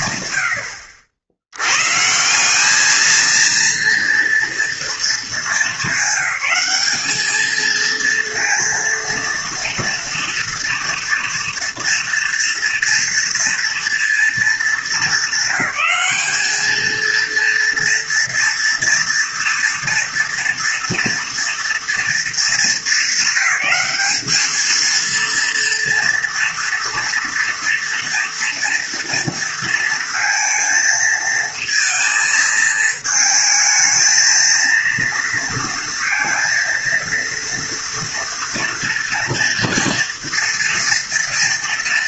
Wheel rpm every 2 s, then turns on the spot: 100, 190, 230, 200, 230, 230, 240, 220, 210, 240, 230, 230, 220, 230, 230, 230, 220, 230, 230, 230, 230.
none